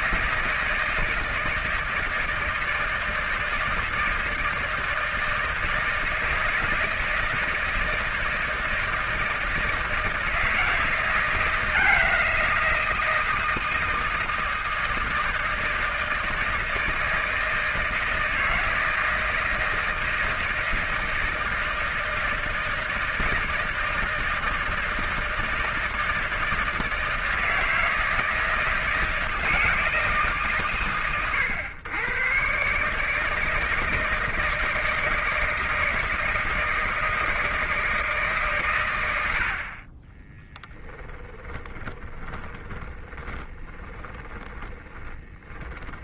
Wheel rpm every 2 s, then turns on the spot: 160, 160, 160, 160, 160, 170, 170, 160, 160, 160, 160, 160, 160, 160, 160, 130, 130, 170, 160, 120, 10, 20, 20.
40-46